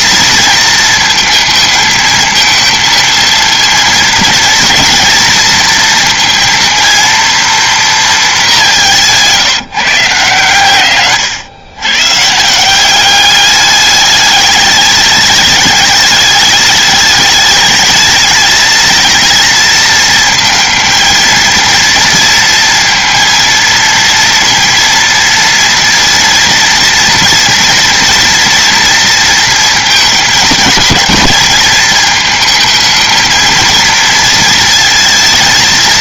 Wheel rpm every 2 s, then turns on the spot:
230, 230, 230, 230, 180, 120, 180, 210, 210, 230, 220, 230, 230, 230, 230, 210, 220, 220.
none